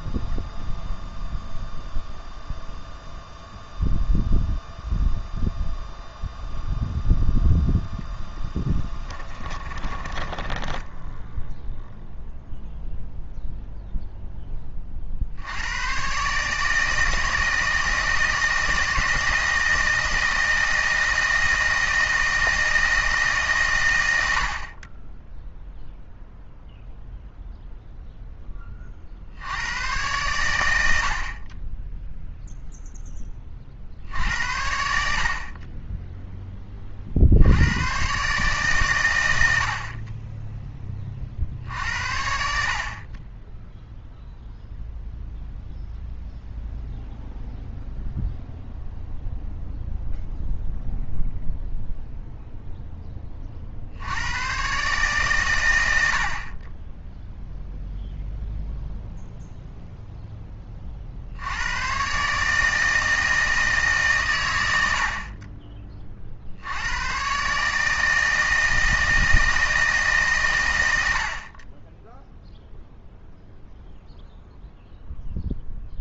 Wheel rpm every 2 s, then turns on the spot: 0, 0, 0, 0, 10, 10, 0, 20, 150, 160, 160, 160, 60, 0, 20, 100, 0, 70, 10, 130, 10, 60, 0, 0, 0, 0, 0, 120, 50, 0, 10, 150, 100, 70, 160, 120, 0, 0.
10-12